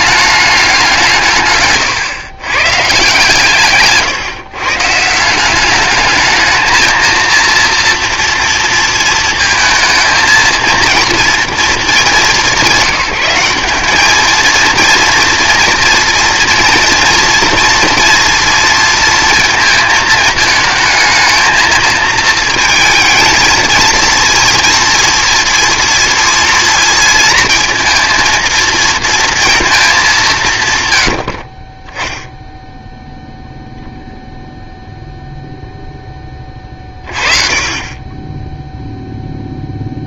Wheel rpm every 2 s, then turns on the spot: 200, 130, 140, 220, 230, 230, 200, 220, 240, 230, 220, 220, 230, 230, 230, 140, 0, 0, 30, 0.
none